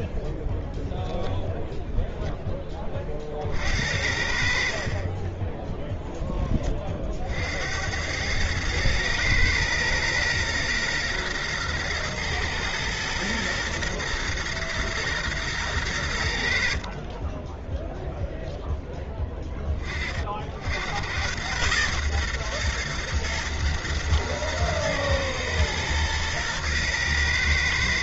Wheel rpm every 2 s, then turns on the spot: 0, 10, 60, 20, 110, 120, 120, 120, 60, 0, 60, 120, 120, 120.
none